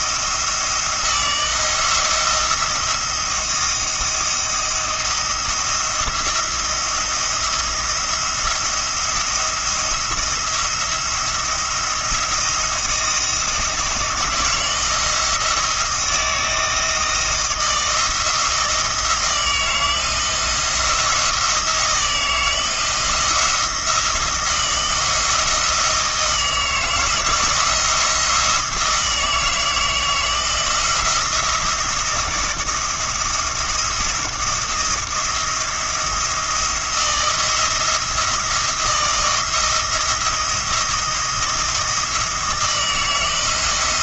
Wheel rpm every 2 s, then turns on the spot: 160, 170, 170, 170, 170, 170, 170, 160, 160, 160, 170, 160, 170, 160, 160, 160, 170, 170, 170, 170, 170, 160.
none